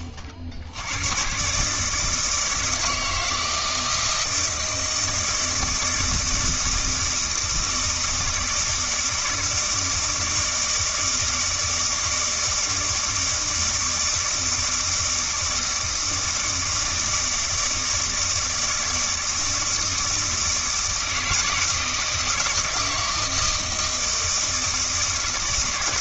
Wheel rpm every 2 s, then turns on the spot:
80, 160, 160, 160, 160, 160, 160, 160, 160, 160, 160, 160, 160.
none